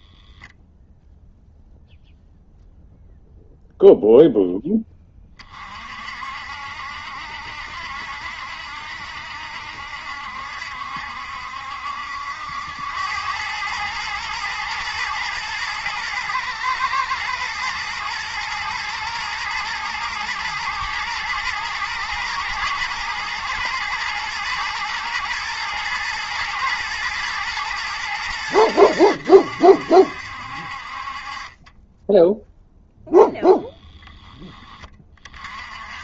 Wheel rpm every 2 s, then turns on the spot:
0, 0, 10, 60, 60, 70, 90, 110, 120, 120, 110, 120, 110, 110, 100, 50, 0, 20.
none